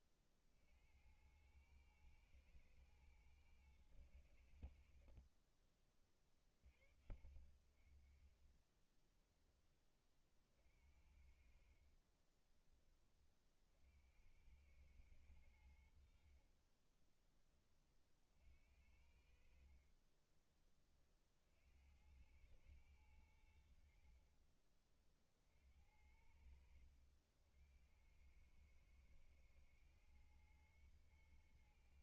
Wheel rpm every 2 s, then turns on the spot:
50, 110, 90, 40, 30, 40, 40, 100, 60, 40, 20, 100, 50, 80, 100, 110.
12-14 20-22 24-28